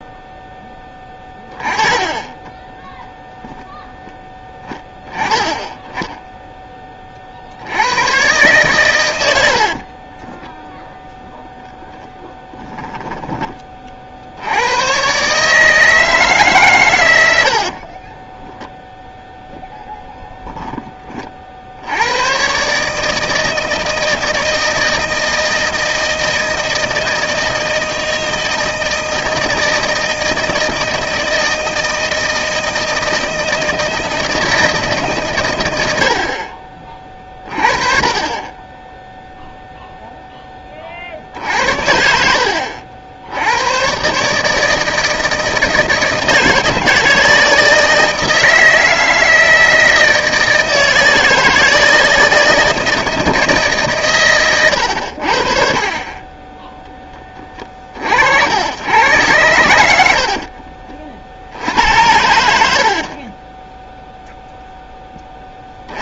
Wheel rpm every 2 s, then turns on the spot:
10, 10, 10, 20, 110, 0, 10, 100, 130, 0, 20, 150, 160, 160, 160, 160, 160, 160, 40, 10, 40, 60, 150, 160, 160, 160, 160, 90, 10, 110, 40, 50, 0.
42-44 62-64